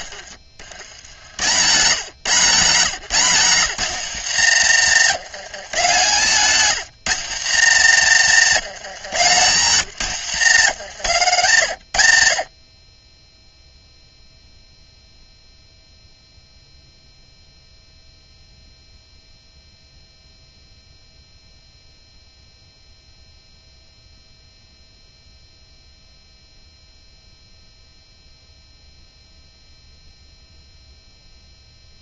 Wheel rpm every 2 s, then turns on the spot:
80, 150, 110, 130, 120, 80, 10, 0, 0, 0, 0, 0, 0, 0, 0, 0.
4-8